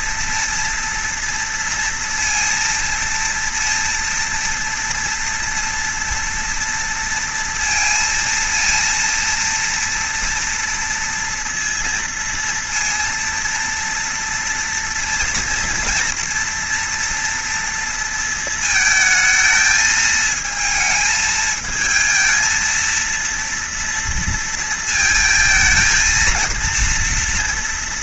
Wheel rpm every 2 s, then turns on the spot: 230, 230, 230, 230, 230, 230, 230, 230, 230, 220, 220, 230, 220, 230.
none